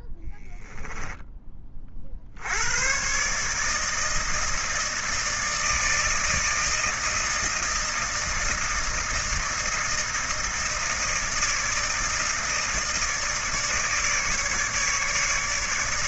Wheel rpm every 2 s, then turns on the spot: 10, 90, 160, 160, 160, 160, 160, 150.
0-2